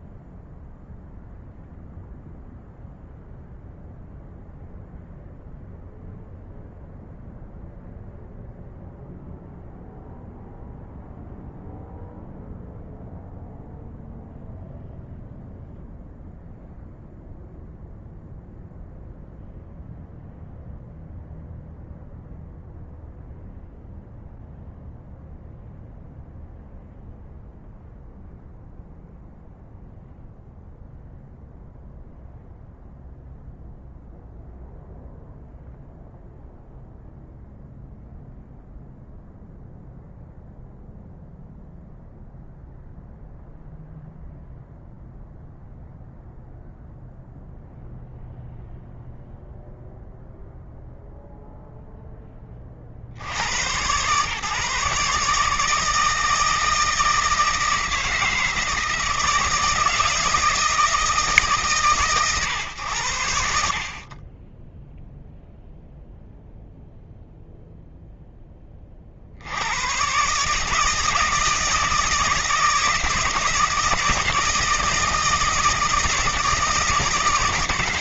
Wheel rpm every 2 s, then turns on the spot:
0, 0, 0, 0, 0, 0, 0, 0, 0, 0, 0, 0, 0, 0, 0, 0, 0, 0, 0, 0, 0, 0, 0, 0, 0, 0, 60, 140, 160, 160, 160, 100, 0, 0, 60, 150, 160, 160, 150.
none